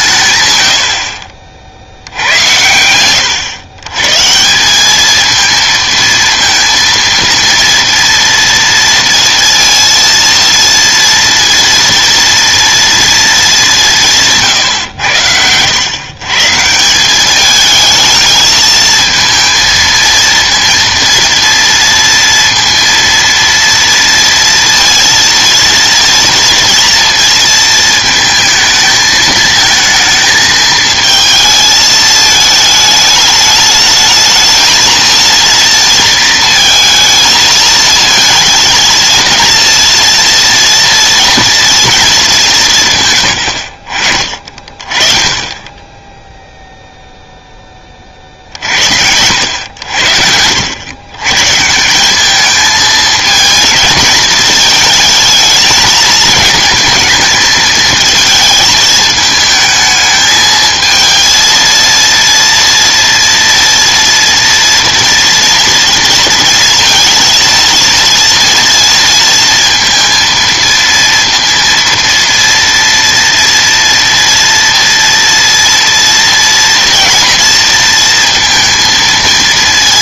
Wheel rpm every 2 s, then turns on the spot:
50, 100, 210, 230, 230, 230, 230, 110, 170, 220, 230, 230, 230, 230, 220, 220, 210, 230, 220, 230, 230, 170, 30, 0, 60, 80, 210, 220, 220, 220, 220, 230, 230, 230, 230, 230, 230, 230, 230, 230.
none